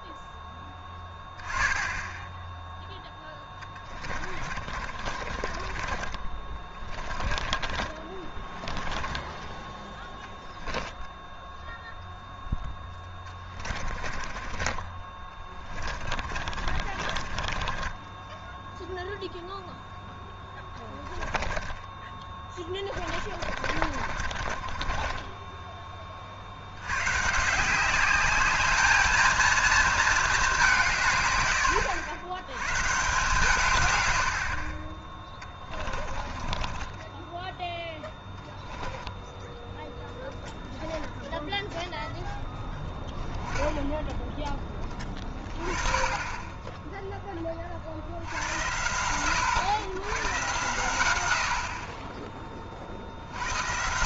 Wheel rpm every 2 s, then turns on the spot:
10, 0, 40, 30, 10, 10, 10, 30, 40, 0, 10, 30, 40, 70, 210, 190, 110, 40, 20, 10, 10, 10, 10, 20, 100, 120, 30.
4-12 14-18 20-26 36-40